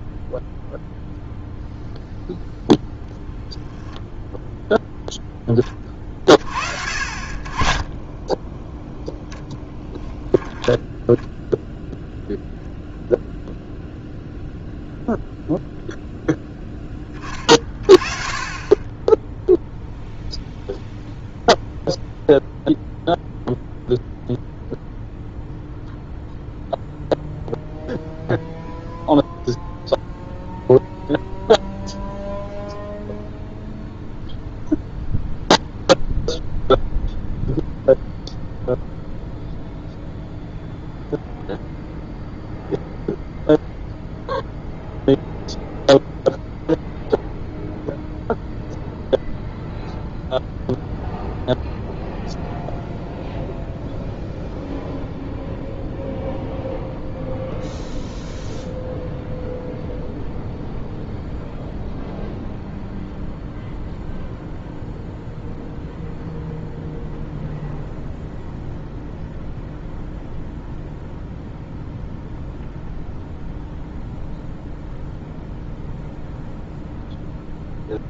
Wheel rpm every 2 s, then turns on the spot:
0, 0, 0, 40, 0, 10, 0, 0, 10, 20, 0, 0, 0, 0, 0, 0, 0, 0, 0, 0, 0, 0, 0, 0, 0, 0, 0, 0, 0, 0, 0, 0, 0, 0, 0, 0, 0, 0, 0.
none